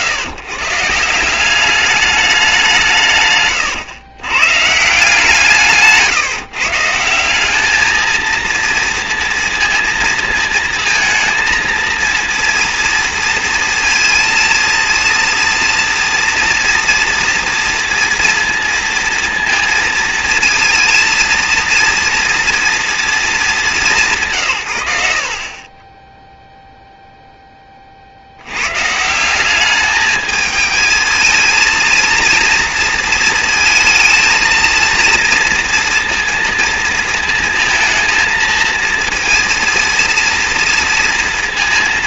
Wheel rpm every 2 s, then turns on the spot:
150, 190, 140, 150, 230, 230, 230, 230, 230, 230, 230, 240, 120, 0, 100, 220, 230, 230, 230, 230, 230.
none